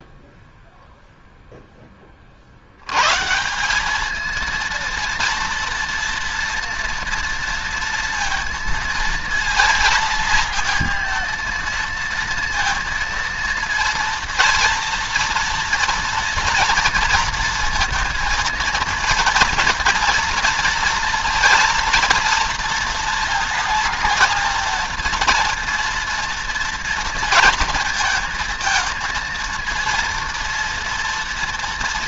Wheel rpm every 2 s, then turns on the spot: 0, 60, 230, 230, 230, 230, 230, 230, 240, 230, 230, 230, 230, 230, 230, 230.
none